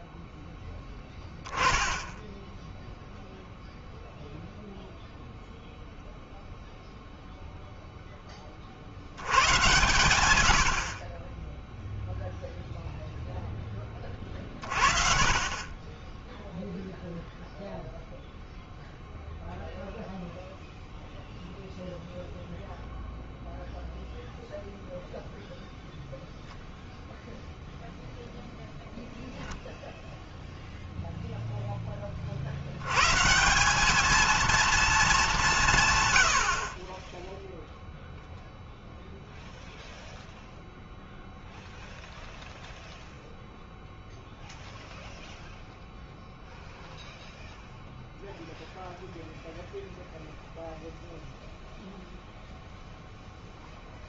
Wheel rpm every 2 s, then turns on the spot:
0, 0, 0, 0, 30, 90, 0, 40, 10, 0, 0, 0, 0, 0, 0, 0, 60, 220, 70, 0, 0, 0, 0, 0, 0, 0, 0.
none